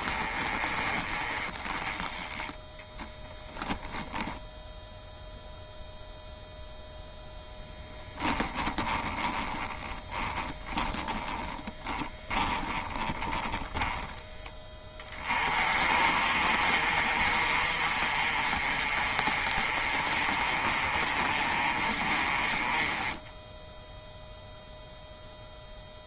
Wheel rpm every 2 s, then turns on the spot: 30, 20, 0, 0, 10, 20, 20, 20, 40, 40, 30, 20, 0.
2-4 8-14